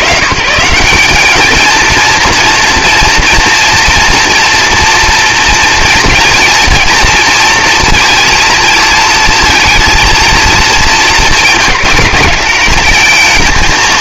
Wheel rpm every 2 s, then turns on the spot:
120, 230, 230, 230, 230, 220, 210.
none